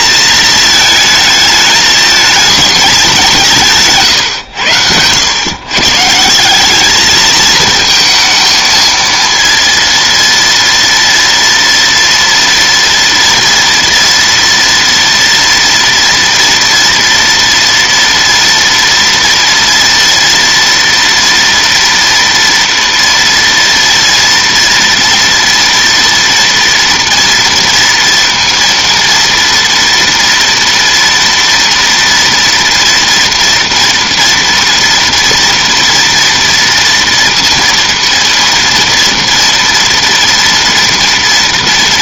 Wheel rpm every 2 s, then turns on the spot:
220, 220, 100, 200, 220, 230, 230, 230, 230, 230, 230, 230, 230, 230, 230, 230, 230, 230, 230, 230, 230.
none